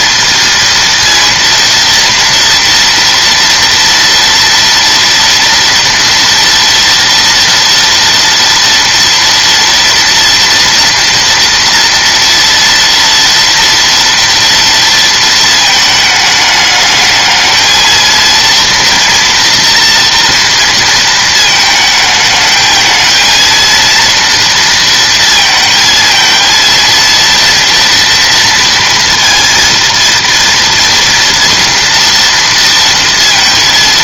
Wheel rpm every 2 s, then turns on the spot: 230, 230, 230, 230, 230, 230, 230, 230, 210, 230, 230, 220, 230, 230, 230, 230, 230.
none